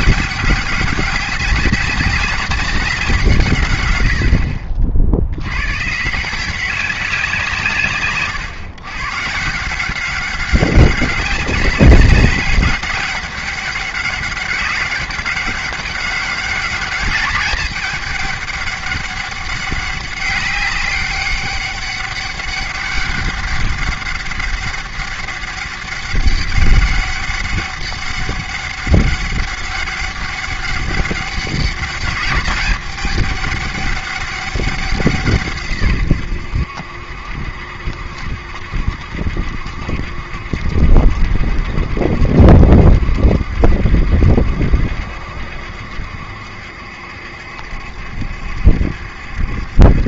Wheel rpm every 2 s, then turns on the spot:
200, 190, 60, 190, 130, 200, 200, 200, 210, 200, 200, 200, 200, 200, 200, 200, 210, 180, 80, 70, 70, 70, 70, 70, 70.
none